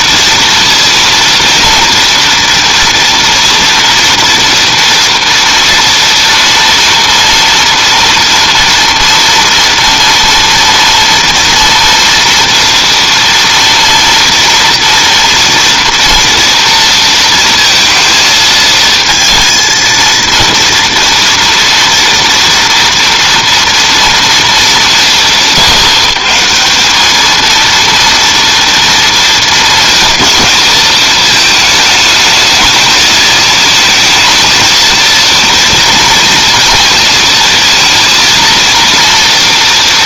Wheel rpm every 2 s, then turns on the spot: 230, 230, 230, 230, 240, 230, 230, 230, 230, 220, 230, 230, 200, 180, 230, 220, 220, 220, 230, 230.
none